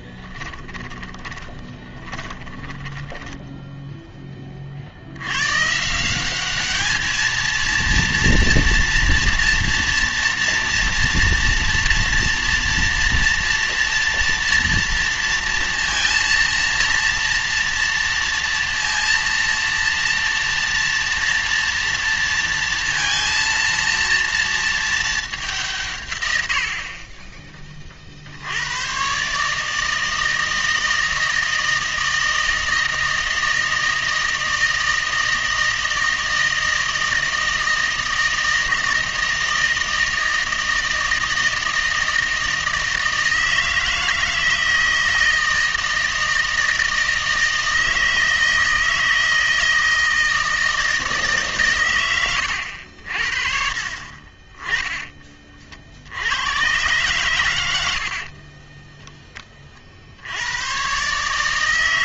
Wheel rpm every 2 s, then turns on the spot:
30, 20, 40, 210, 230, 230, 230, 230, 230, 230, 230, 230, 220, 70, 100, 160, 160, 160, 160, 160, 160, 160, 160, 160, 160, 160, 90, 20, 110, 20, 100.
0-4 58-60